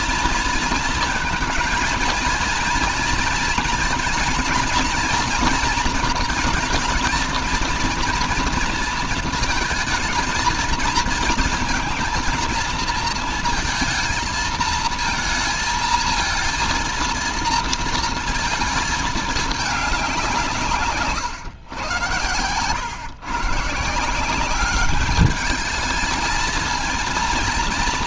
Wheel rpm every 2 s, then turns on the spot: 230, 230, 230, 230, 230, 230, 230, 230, 230, 220, 160, 120, 200, 230.
none